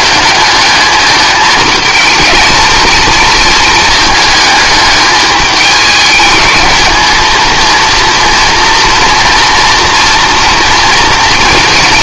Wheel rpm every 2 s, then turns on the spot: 210, 230, 210, 220, 230, 230.
none